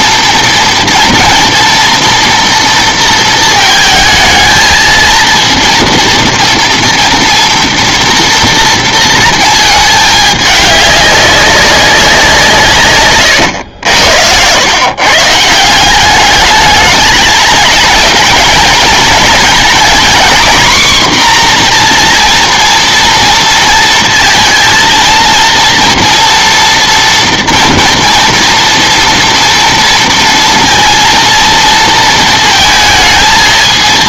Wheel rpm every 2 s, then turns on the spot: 240, 230, 220, 230, 230, 210, 160, 110, 210, 230, 240, 230, 230, 240, 230, 230, 220.
none